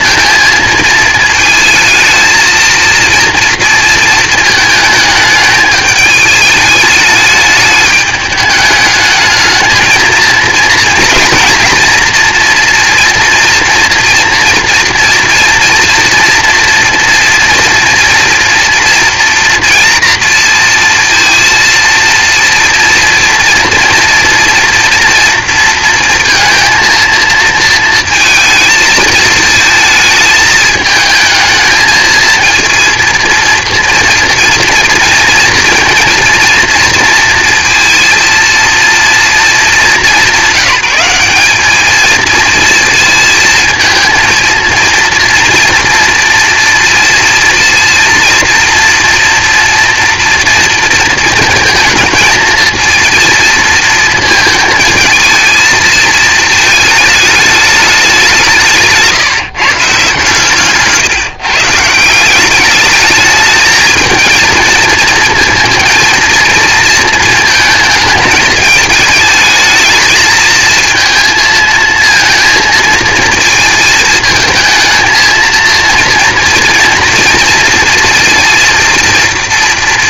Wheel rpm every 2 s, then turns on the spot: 220, 230, 220, 210, 210, 230, 230, 230, 230, 230, 230, 230, 230, 230, 220, 220, 230, 240, 230, 230, 200, 220, 230, 230, 240, 230, 230, 230, 220, 170, 140, 210, 230, 230, 220, 220, 220, 220, 230, 230.
none